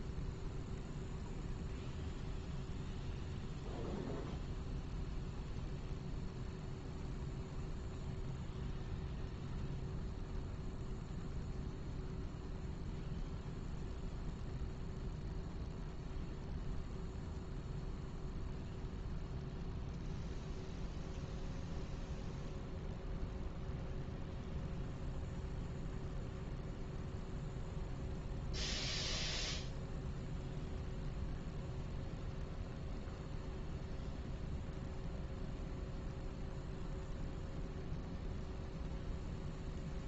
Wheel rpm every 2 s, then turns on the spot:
0, 0, 0, 0, 0, 0, 0, 0, 0, 0, 0, 0, 0, 0, 0, 0, 0, 0, 0, 0.
none